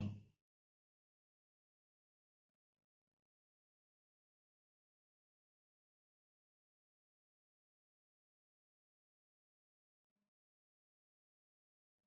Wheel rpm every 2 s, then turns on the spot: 0, 0, 0, 0, 0, 0.
none